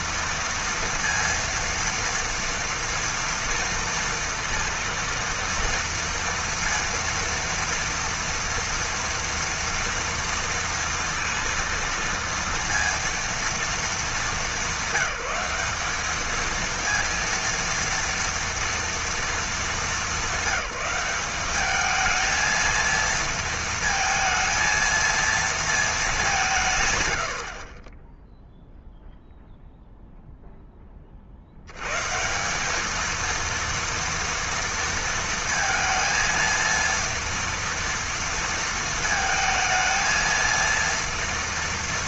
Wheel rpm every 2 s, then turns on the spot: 230, 230, 230, 230, 240, 230, 230, 200, 230, 220, 200, 230, 230, 50, 0, 90, 230, 230, 230, 220, 230.
none